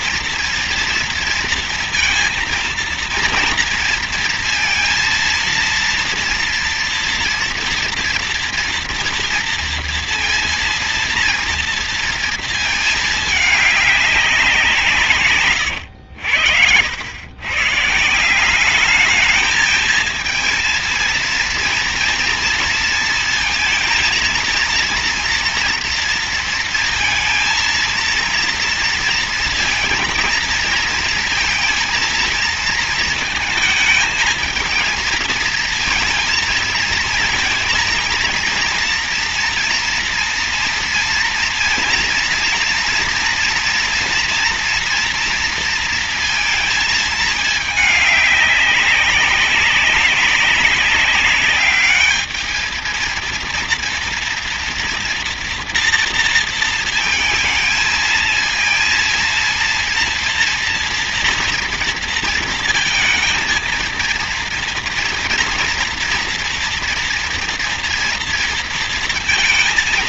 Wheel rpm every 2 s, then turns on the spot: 230, 230, 230, 230, 230, 230, 220, 160, 100, 210, 230, 230, 230, 220, 230, 230, 220, 220, 230, 230, 230, 230, 230, 220, 200, 200, 230, 230, 220, 230, 230, 230, 230, 230, 230.
none